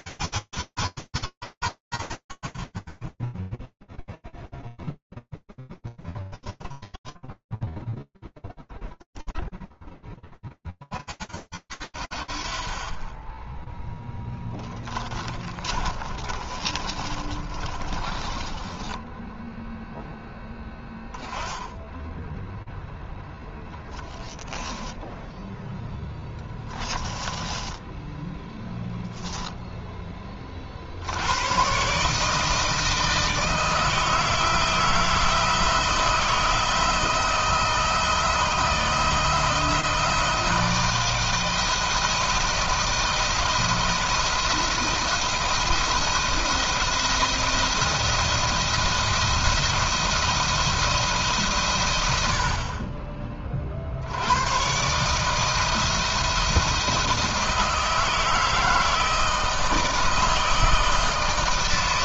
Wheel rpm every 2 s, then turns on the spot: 80, 50, 0, 10, 0, 10, 60, 10, 30, 20, 0, 10, 10, 10, 10, 100, 160, 160, 160, 160, 160, 170, 170, 170, 170, 150, 30, 150, 160, 160, 160.
6-8 14-20 24-28